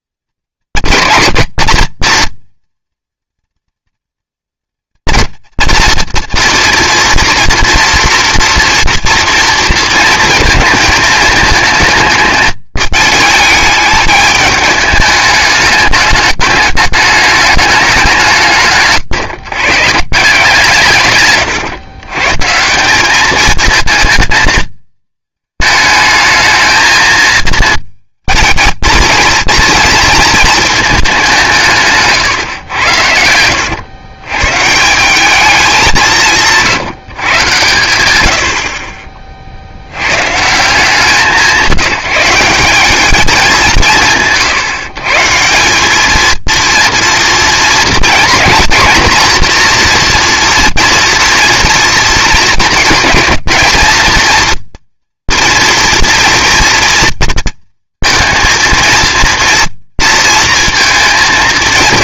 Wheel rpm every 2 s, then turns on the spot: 230, 240, 230, 230, 230, 220, 210, 210, 210, 150, 160, 170, 220, 220, 220, 220, 100, 140, 160, 50, 160, 190, 140, 230, 230, 230, 220, 240, 230, 230, 230.
18-20